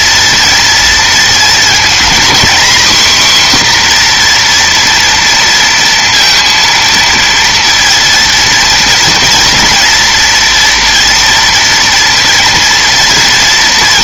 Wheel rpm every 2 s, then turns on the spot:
230, 250, 240, 230, 230, 230, 230.
none